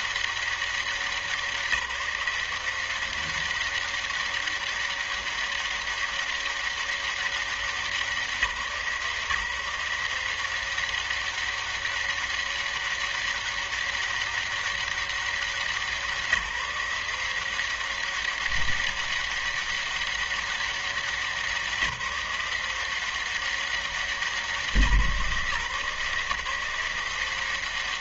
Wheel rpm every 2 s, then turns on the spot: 200, 170, 200, 200, 160, 170, 200, 200, 180, 190, 200, 180, 180, 150.
none